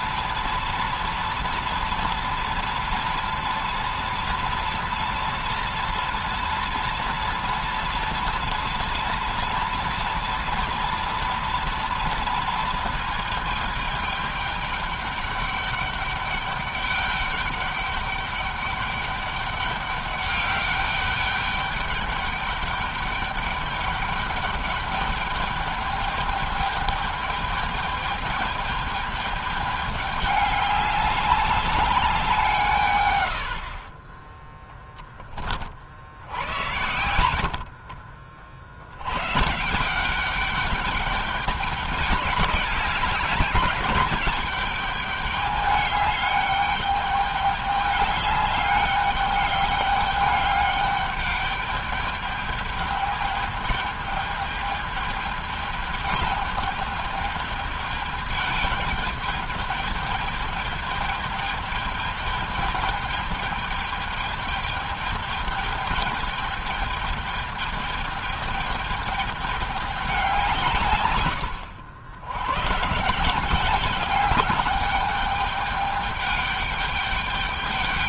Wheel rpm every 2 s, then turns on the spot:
240, 230, 230, 230, 230, 230, 220, 200, 200, 200, 200, 210, 210, 210, 210, 200, 110, 20, 80, 110, 210, 210, 210, 210, 200, 210, 210, 210, 210, 210, 210, 210, 210, 210, 210, 120, 170, 200, 210.
36-38